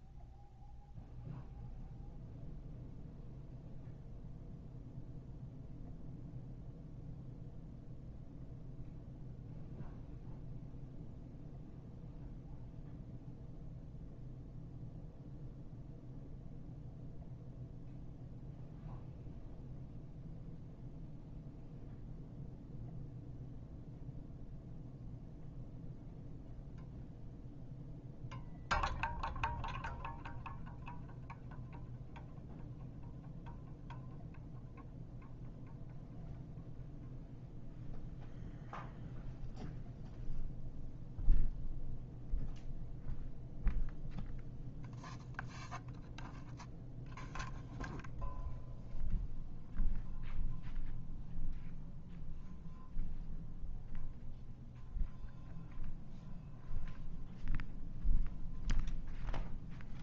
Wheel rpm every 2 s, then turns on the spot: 0, 0, 0, 0, 0, 0, 0, 0, 0, 0, 0, 0, 0, 0, 0, 0, 0, 0, 0, 0, 0, 0, 0, 0, 0, 0, 0, 0, 0, 0.
none